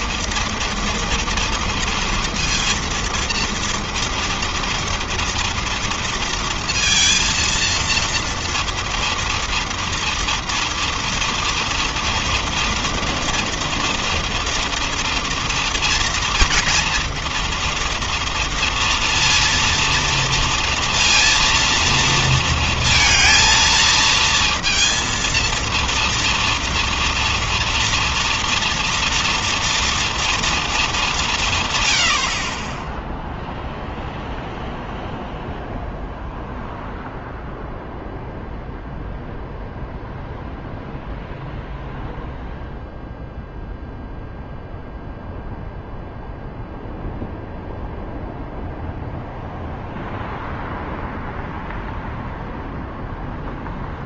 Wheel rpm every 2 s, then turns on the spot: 230, 230, 230, 230, 230, 230, 230, 230, 240, 230, 230, 230, 230, 230, 230, 180, 0, 0, 0, 0, 0, 0, 0, 0, 0, 0, 0.
none